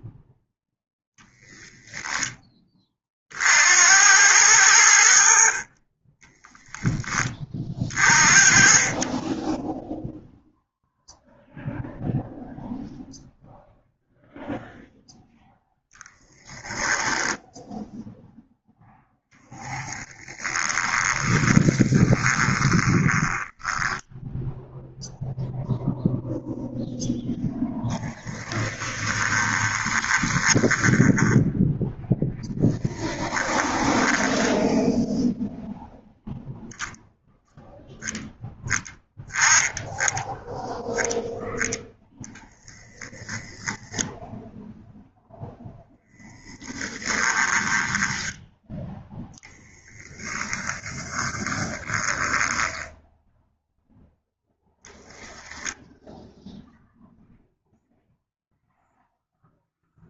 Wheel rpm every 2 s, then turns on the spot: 0, 30, 80, 10, 20, 0, 0, 0, 10, 0, 20, 20, 0, 0, 10, 10, 10, 0, 10, 10, 0, 0, 0, 10, 10, 30, 10, 0, 0, 0.
16-18 20-24 28-32 46-48 50-52